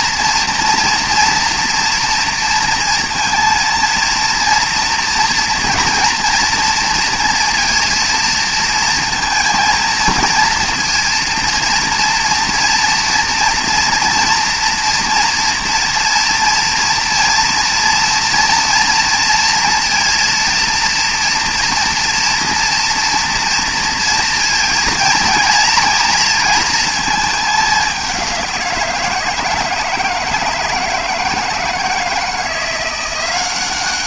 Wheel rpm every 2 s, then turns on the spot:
230, 230, 240, 230, 230, 230, 230, 230, 230, 230, 230, 230, 230, 220, 170, 160, 170.
none